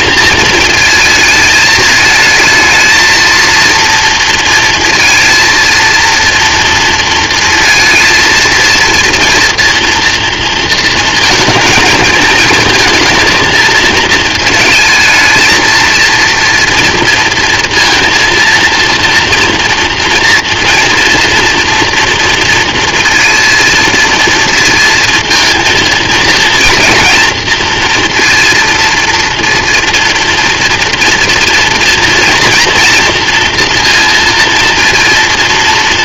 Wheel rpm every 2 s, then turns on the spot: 220, 220, 230, 230, 230, 230, 220, 220, 230, 230, 240, 230, 230, 230, 230, 230, 230, 230.
none